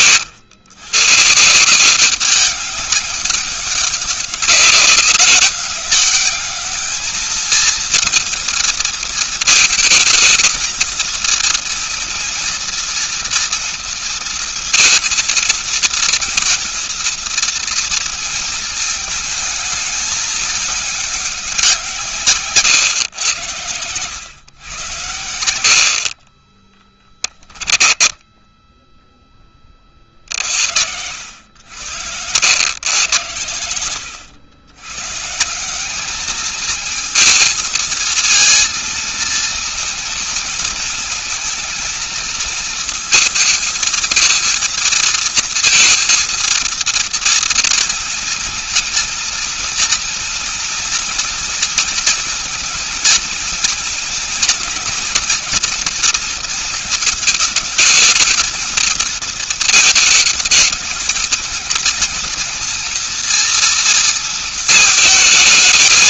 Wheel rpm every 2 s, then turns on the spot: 120, 190, 200, 210, 220, 230, 240, 230, 230, 220, 200, 120, 110, 20, 10, 80, 110, 120, 220, 230, 230, 220, 230, 230, 230, 240, 230, 230, 220, 230, 220, 230, 220.
26-30